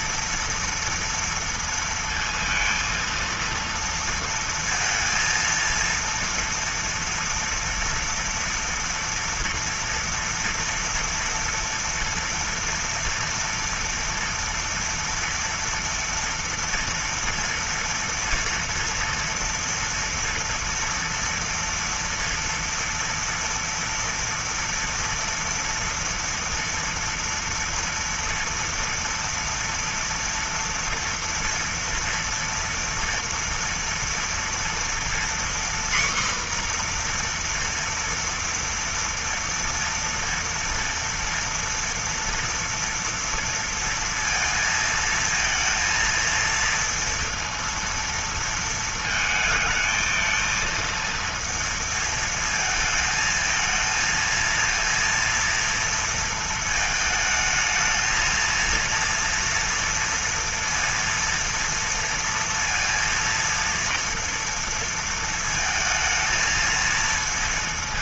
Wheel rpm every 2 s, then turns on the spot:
230, 230, 230, 230, 230, 230, 240, 230, 230, 230, 230, 230, 230, 230, 230, 240, 230, 240, 250, 230, 230, 230, 230, 230, 220, 230, 220, 230, 220, 230, 230, 230, 230, 230.
none